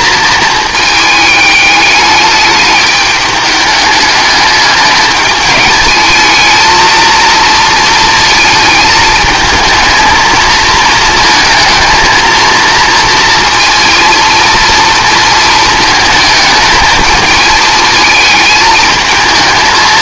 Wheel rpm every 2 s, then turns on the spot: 220, 210, 210, 220, 220, 230, 230, 230, 220, 220.
none